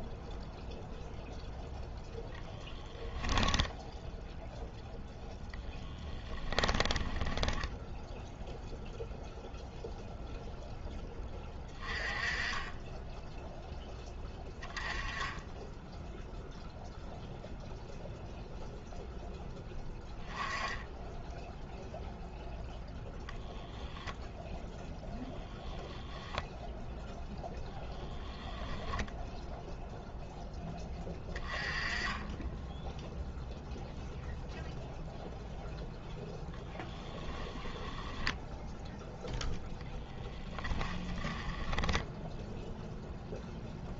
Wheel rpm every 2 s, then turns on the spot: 0, 10, 0, 10, 0, 0, 10, 10, 0, 0, 10, 0, 10, 0, 10, 10, 10, 0, 10, 0, 10, 0.
2-4 6-8 40-42